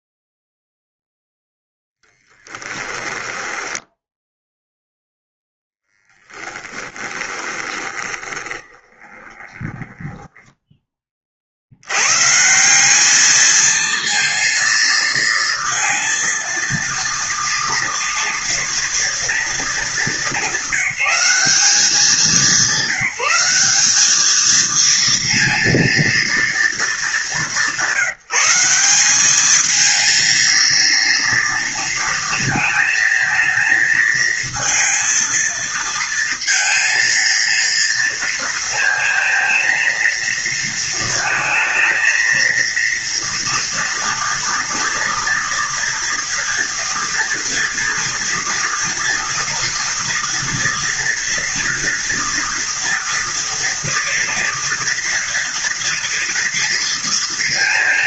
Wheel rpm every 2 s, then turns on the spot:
0, 10, 10, 20, 20, 20, 190, 230, 230, 230, 200, 190, 230, 220, 190, 230, 230, 230, 230, 230, 230, 230, 230, 230, 230, 240, 240, 230, 230.
2-4 6-10